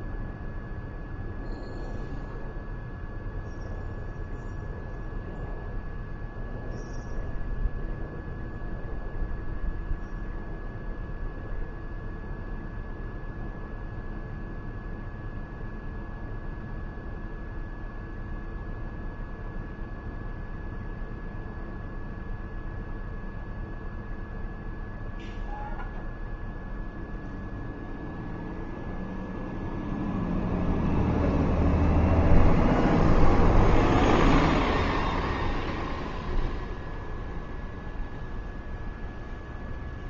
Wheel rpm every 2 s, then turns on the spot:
0, 0, 0, 0, 0, 0, 0, 0, 0, 0, 0, 0, 0, 0, 0, 0, 0, 0, 0, 0.
none